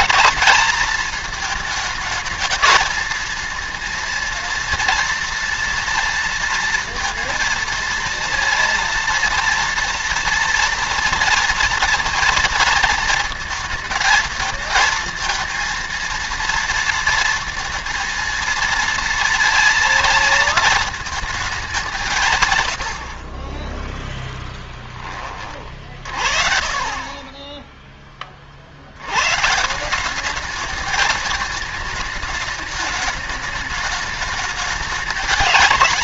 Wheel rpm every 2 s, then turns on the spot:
220, 220, 230, 230, 230, 230, 230, 220, 230, 230, 220, 120, 0, 50, 50, 210, 220, 210.
26-28